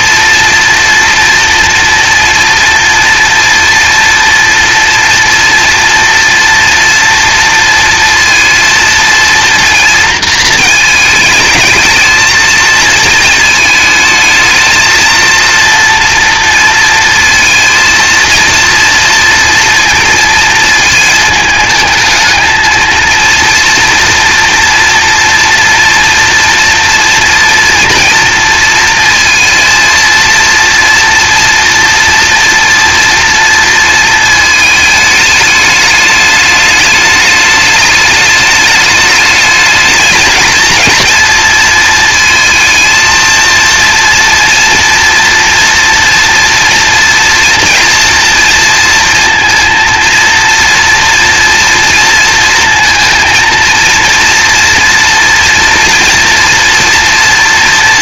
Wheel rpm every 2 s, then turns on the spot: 230, 230, 230, 230, 230, 230, 220, 220, 230, 230, 230, 220, 240, 230, 230, 230, 230, 220, 210, 210, 220, 220, 230, 230, 230, 230, 230, 240, 230.
none